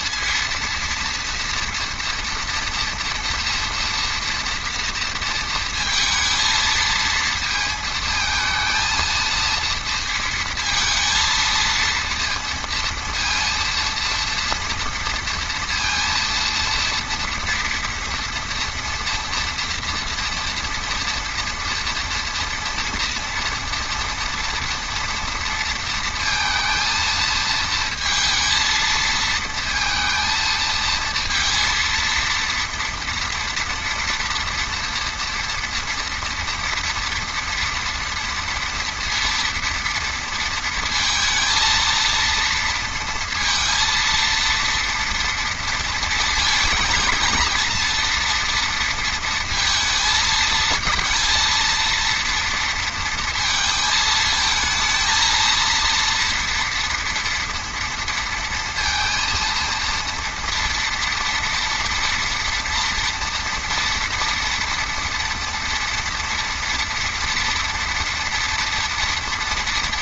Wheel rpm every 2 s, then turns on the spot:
230, 230, 230, 220, 220, 230, 230, 230, 230, 230, 240, 230, 230, 230, 230, 230, 230, 230, 230, 230, 230, 230, 230, 220, 230, 230, 230, 220, 230, 230, 230, 240, 230, 230, 230.
none